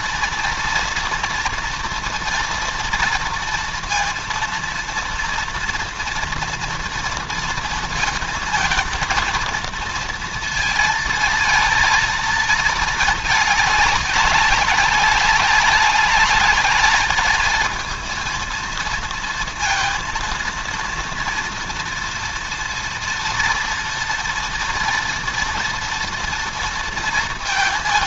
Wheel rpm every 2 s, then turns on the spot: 230, 230, 230, 230, 230, 230, 220, 190, 210, 230, 230, 230, 230, 230.
none